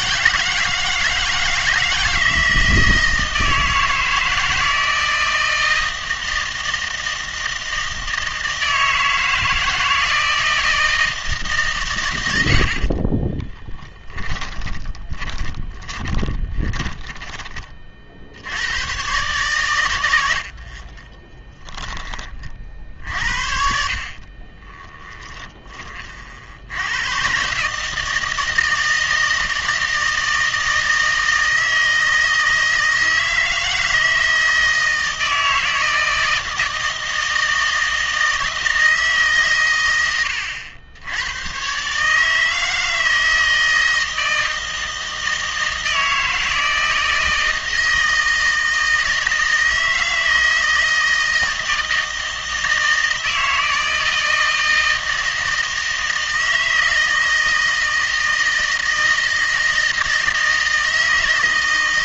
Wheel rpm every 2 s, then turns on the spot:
160, 160, 160, 160, 160, 160, 60, 10, 20, 100, 50, 50, 20, 80, 160, 160, 160, 160, 160, 160, 80, 160, 160, 160, 160, 160, 160, 160, 160, 160, 160.
12-18 20-22 24-26